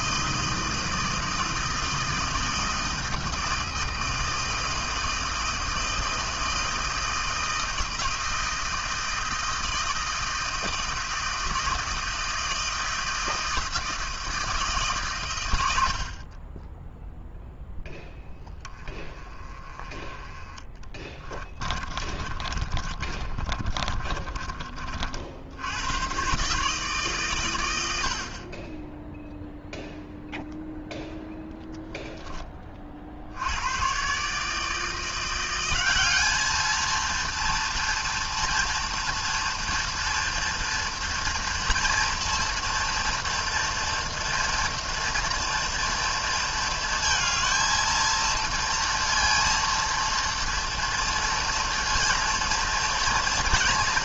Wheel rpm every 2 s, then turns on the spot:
160, 160, 160, 160, 160, 160, 160, 150, 20, 10, 30, 40, 30, 140, 20, 0, 20, 150, 220, 230, 230, 230, 230, 230, 230, 230, 230.
20-24